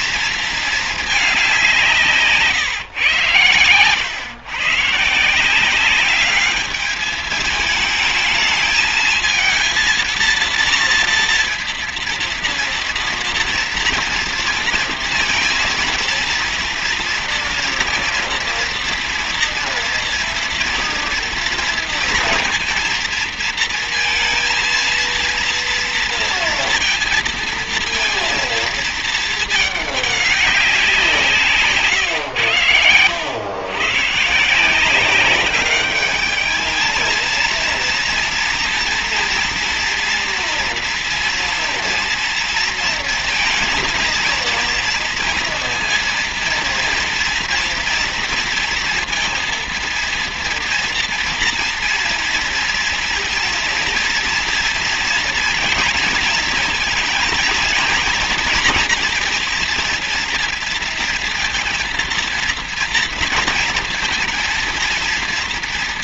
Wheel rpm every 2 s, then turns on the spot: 220, 140, 130, 200, 210, 230, 230, 230, 230, 230, 230, 230, 230, 230, 220, 190, 100, 160, 220, 240, 230, 230, 230, 230, 230, 230, 230, 230, 230, 230, 230, 230, 230.
32-34